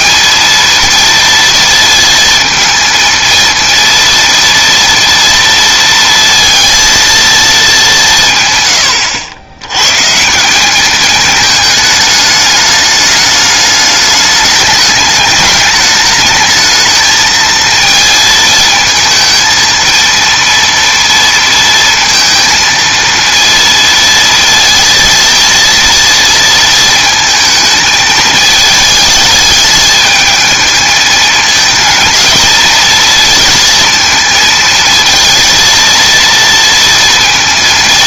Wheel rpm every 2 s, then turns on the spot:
230, 230, 230, 230, 120, 200, 210, 210, 220, 220, 230, 230, 230, 230, 210, 220, 230, 230, 230.
none